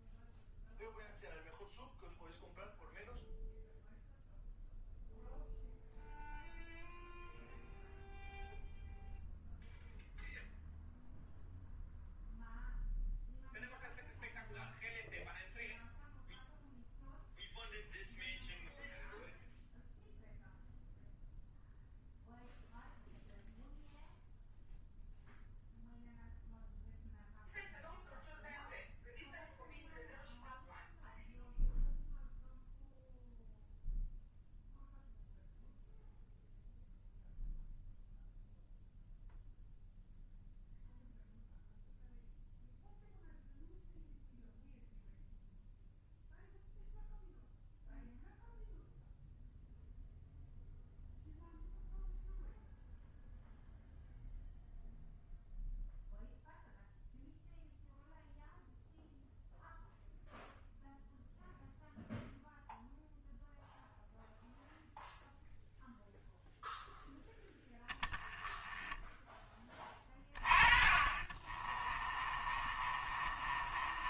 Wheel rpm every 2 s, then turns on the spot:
0, 0, 0, 0, 0, 0, 0, 0, 0, 0, 0, 0, 0, 0, 0, 0, 0, 0, 0, 0, 0, 0, 0, 0, 0, 0, 0, 0, 0, 0, 0, 0, 0, 0, 10, 30, 30.
70-74